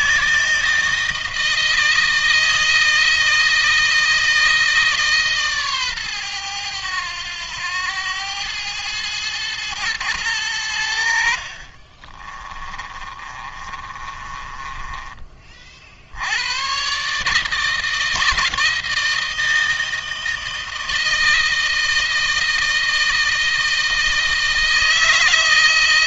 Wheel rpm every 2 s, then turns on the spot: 160, 160, 150, 100, 110, 90, 30, 20, 130, 160, 160, 160, 160.
12-14